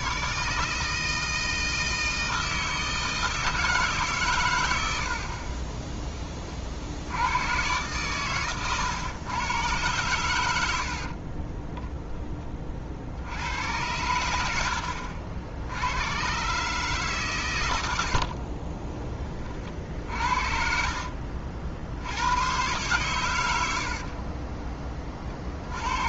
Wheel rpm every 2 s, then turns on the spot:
160, 160, 110, 40, 120, 80, 30, 70, 140, 30, 50, 120, 20.
10-12 18-20